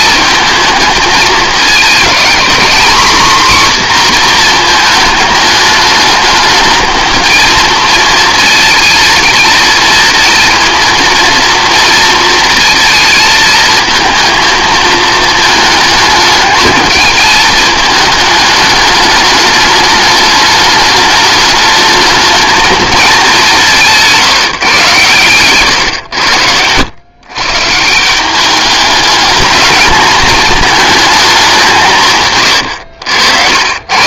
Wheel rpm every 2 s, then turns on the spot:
220, 250, 230, 220, 220, 230, 220, 220, 220, 210, 210, 210, 130, 100, 210, 220, 110.
none